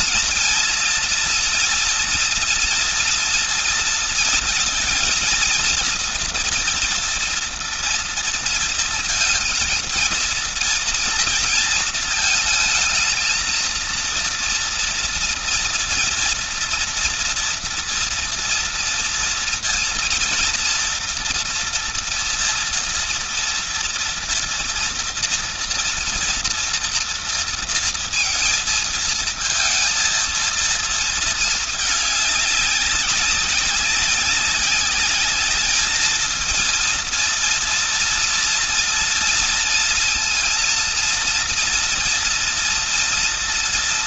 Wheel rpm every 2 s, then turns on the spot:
230, 230, 220, 230, 230, 230, 220, 230, 230, 230, 230, 230, 230, 230, 230, 230, 200, 200, 230, 230, 230, 240.
none